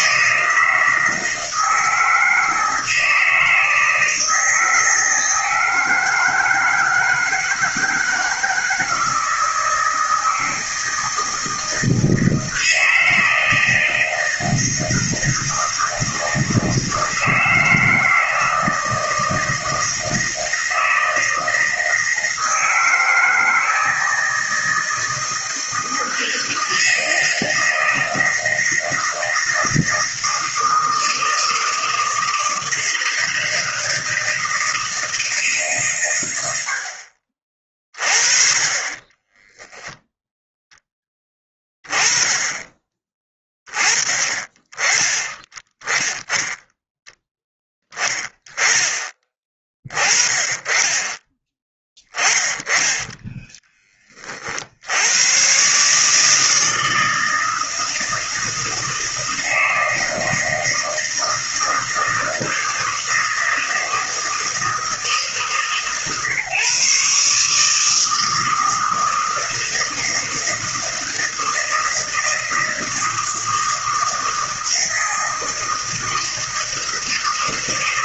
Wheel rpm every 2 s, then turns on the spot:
160, 160, 160, 160, 160, 160, 160, 160, 160, 160, 160, 160, 160, 160, 160, 160, 160, 160, 70, 30, 10, 20, 30, 0, 20, 20, 10, 60, 160, 160, 160, 160, 160, 140, 160, 160, 160, 160, 160.
none